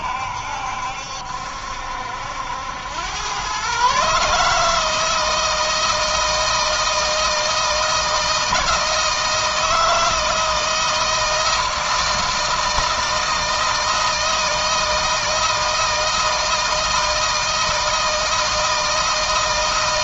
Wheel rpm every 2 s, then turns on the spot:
70, 80, 140, 160, 160, 160, 160, 160, 160, 160.
none